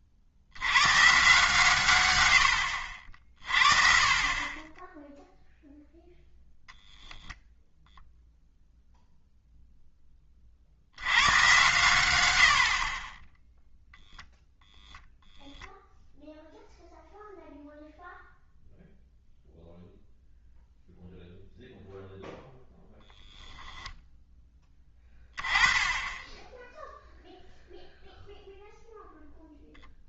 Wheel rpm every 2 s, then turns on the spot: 100, 80, 20, 0, 0, 60, 70, 0, 0, 0, 0, 0, 10, 10, 0.
none